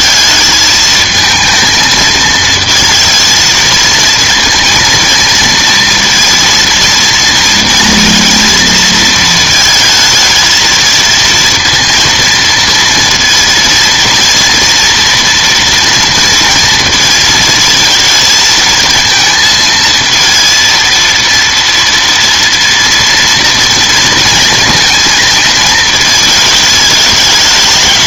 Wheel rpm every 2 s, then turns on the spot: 220, 220, 230, 230, 230, 230, 230, 230, 230, 230, 230, 230, 230, 220.
none